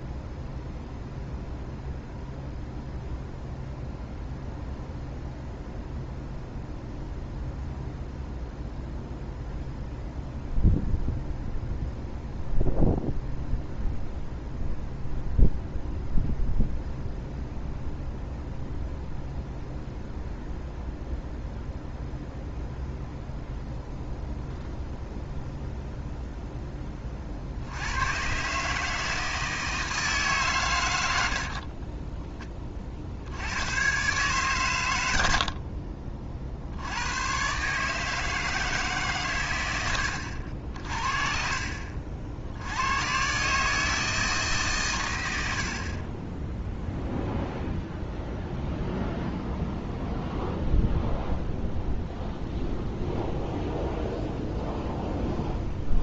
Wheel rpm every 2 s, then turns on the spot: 0, 0, 0, 0, 0, 0, 0, 0, 0, 0, 0, 0, 0, 10, 150, 120, 30, 120, 60, 150, 60, 90, 130, 0, 0, 0, 0, 0.
none